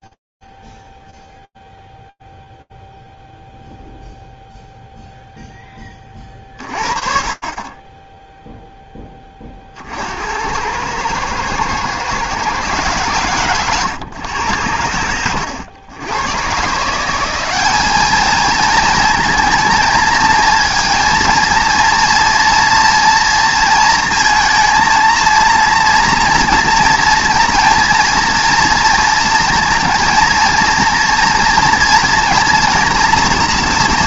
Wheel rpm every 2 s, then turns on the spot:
0, 0, 0, 40, 10, 90, 130, 100, 130, 220, 230, 230, 230, 230, 230, 230, 230.
none